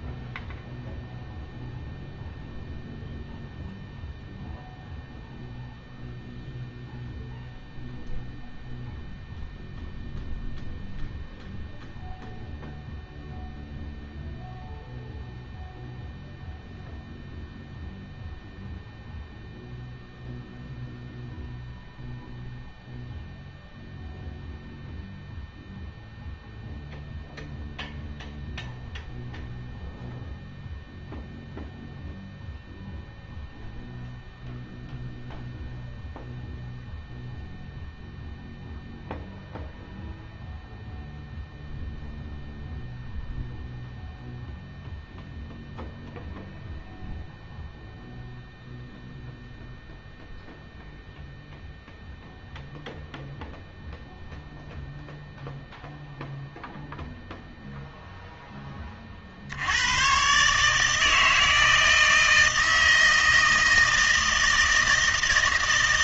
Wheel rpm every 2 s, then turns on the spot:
0, 0, 0, 0, 0, 0, 0, 0, 0, 0, 0, 0, 0, 0, 0, 0, 0, 0, 0, 0, 0, 0, 0, 0, 0, 0, 0, 0, 0, 10, 140, 160, 160.
none